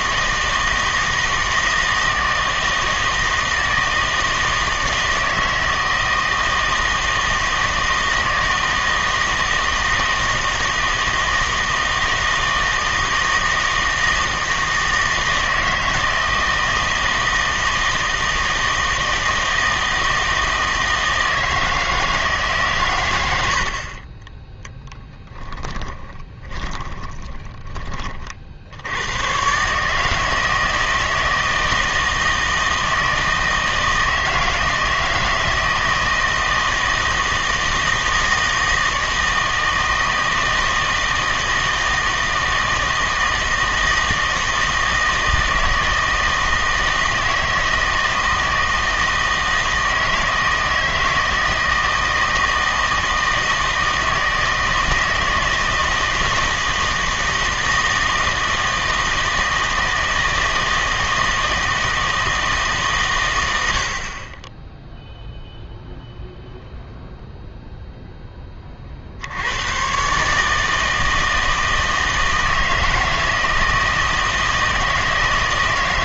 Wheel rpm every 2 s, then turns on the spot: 160, 160, 160, 160, 160, 160, 160, 160, 160, 160, 160, 140, 10, 20, 60, 160, 160, 160, 160, 160, 160, 160, 160, 160, 160, 160, 160, 160, 160, 160, 160, 150, 10, 0, 30, 150, 160, 160.
26-28